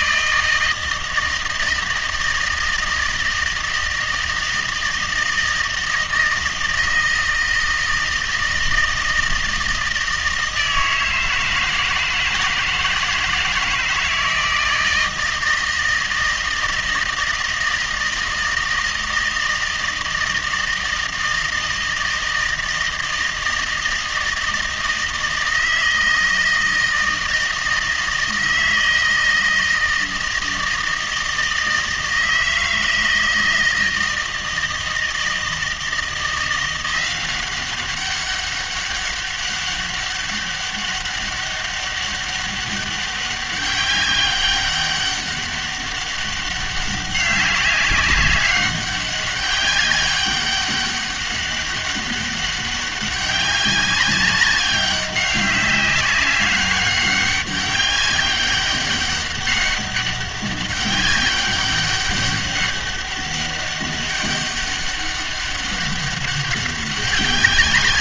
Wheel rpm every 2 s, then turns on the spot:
160, 160, 160, 160, 160, 160, 160, 160, 160, 160, 160, 160, 160, 160, 160, 160, 160, 160, 170, 200, 200, 200, 200, 200, 200, 200, 200, 190, 200, 200, 200, 200, 200, 200.
none